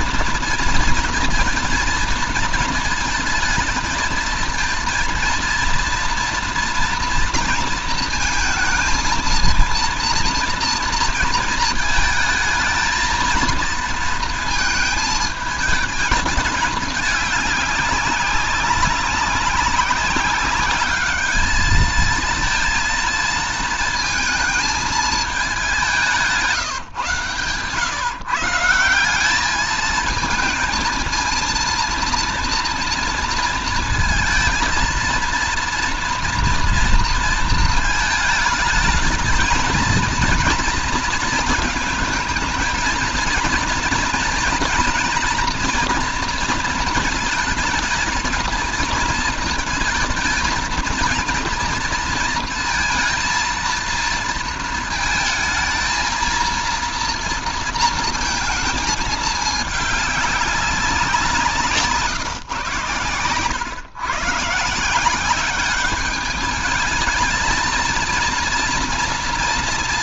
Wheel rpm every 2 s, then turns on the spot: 230, 220, 230, 240, 220, 230, 220, 220, 210, 200, 200, 230, 220, 170, 160, 230, 230, 220, 230, 230, 230, 220, 240, 230, 230, 230, 230, 230, 230, 220, 200, 120, 150, 210, 230.
none